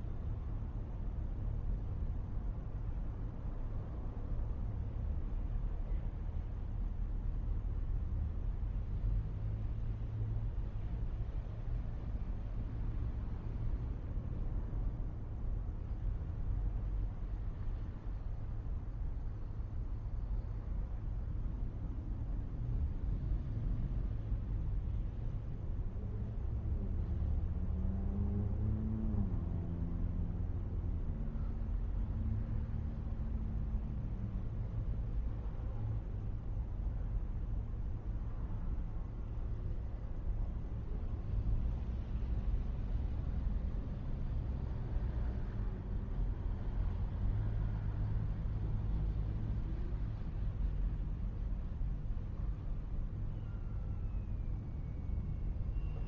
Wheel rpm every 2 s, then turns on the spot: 0, 0, 0, 0, 0, 0, 0, 0, 0, 0, 0, 0, 0, 0, 0, 0, 0, 0, 0, 0, 0, 0, 0, 0, 0, 0, 0, 0.
none